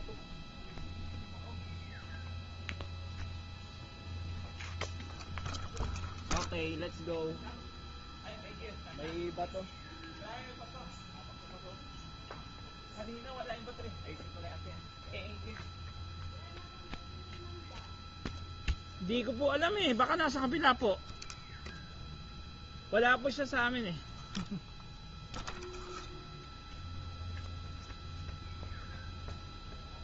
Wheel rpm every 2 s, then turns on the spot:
0, 0, 0, 0, 0, 0, 0, 0, 0, 0, 0, 0, 0, 0, 0.
none